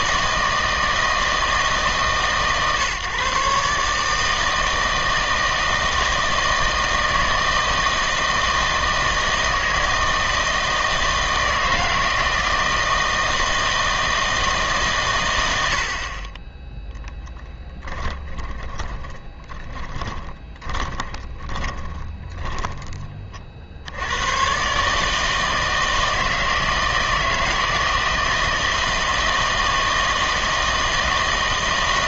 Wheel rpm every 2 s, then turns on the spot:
160, 140, 160, 160, 160, 160, 160, 150, 10, 20, 20, 30, 120, 160, 160, 160.
18-24